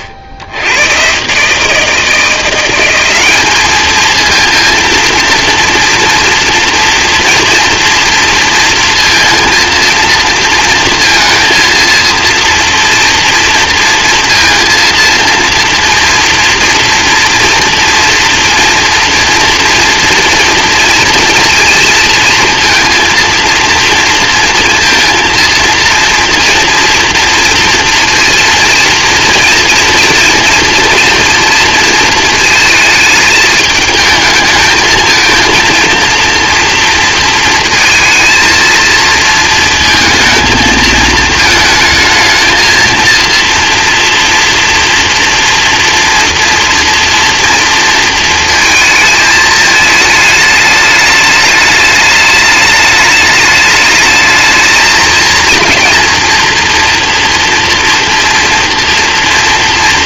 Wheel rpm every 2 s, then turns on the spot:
100, 180, 230, 230, 230, 230, 230, 230, 230, 230, 230, 230, 230, 230, 230, 230, 220, 220, 230, 230, 220, 230, 230, 230, 220, 210, 210, 220, 230, 240.
none